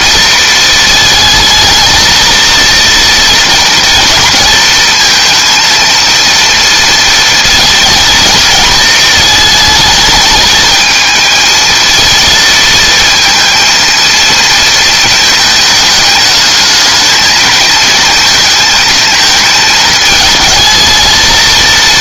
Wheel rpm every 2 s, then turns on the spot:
220, 230, 230, 230, 220, 220, 230, 220, 220, 220, 220.
none